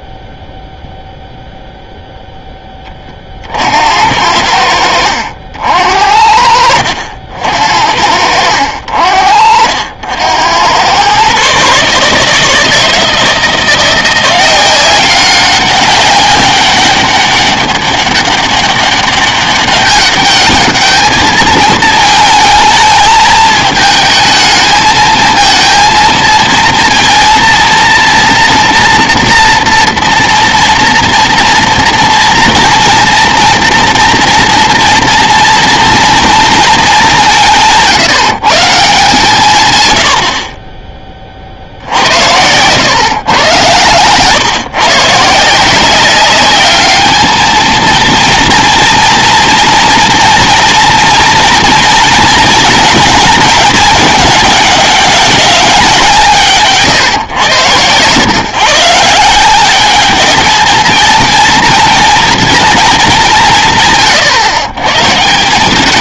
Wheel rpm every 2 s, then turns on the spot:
0, 10, 80, 60, 70, 90, 160, 180, 200, 200, 210, 220, 220, 230, 230, 230, 230, 230, 220, 150, 40, 90, 140, 200, 230, 230, 220, 210, 160, 140, 210, 230, 120.
none